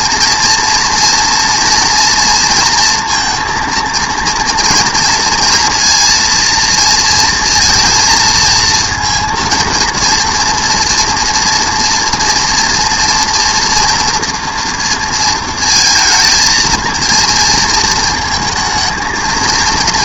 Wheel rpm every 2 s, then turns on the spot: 240, 230, 230, 230, 230, 230, 240, 230, 230, 220.
none